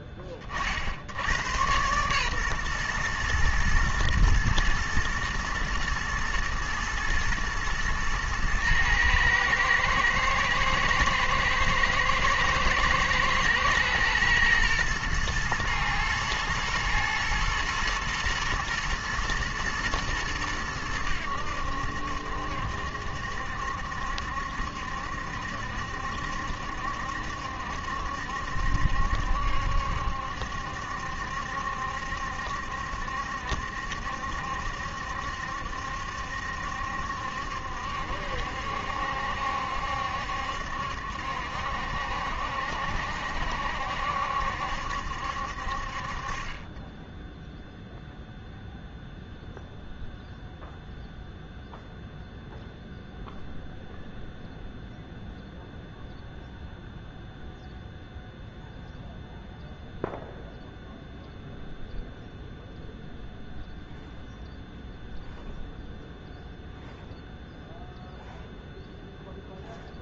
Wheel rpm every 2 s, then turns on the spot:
40, 130, 110, 110, 110, 110, 110, 110, 120, 110, 100, 70, 70, 70, 70, 70, 70, 70, 70, 70, 70, 70, 70, 30, 0, 0, 0, 0, 0, 0, 0, 0, 0, 0, 0.
none